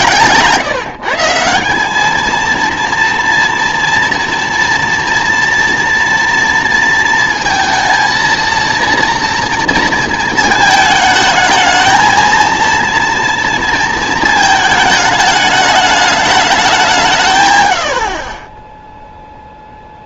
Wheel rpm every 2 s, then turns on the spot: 150, 230, 230, 230, 230, 220, 230, 220, 190, 10.
none